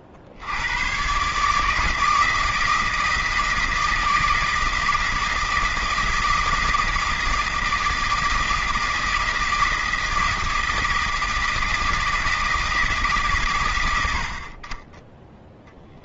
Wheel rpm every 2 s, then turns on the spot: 80, 160, 160, 160, 160, 160, 160, 50.
none